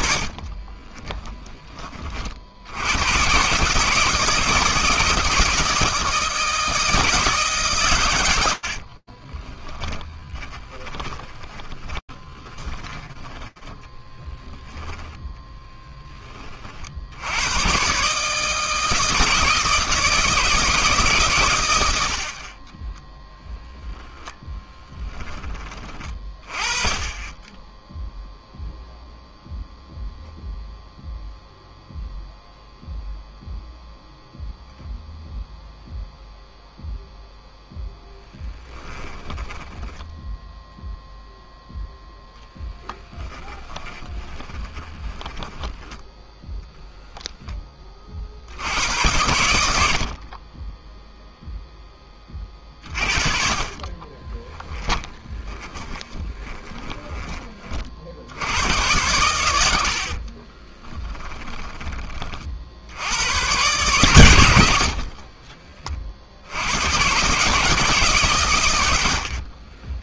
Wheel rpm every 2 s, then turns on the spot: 30, 90, 160, 160, 50, 20, 20, 10, 80, 160, 150, 10, 20, 10, 0, 0, 0, 0, 0, 20, 0, 10, 30, 10, 90, 0, 40, 20, 20, 100, 20, 90, 40, 130, 70.
0-2 8-16 22-24 38-40 42-46 54-56 60-62 64-66 68-70